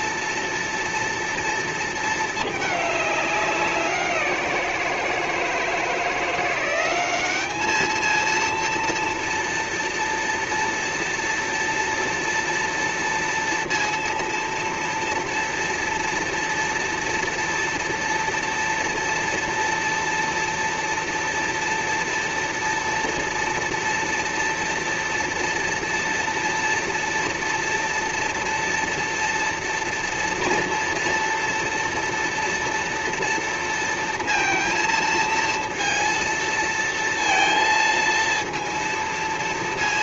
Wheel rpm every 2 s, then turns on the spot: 230, 220, 180, 170, 230, 230, 230, 230, 230, 230, 240, 240, 230, 230, 230, 230, 230, 230, 230, 230.
none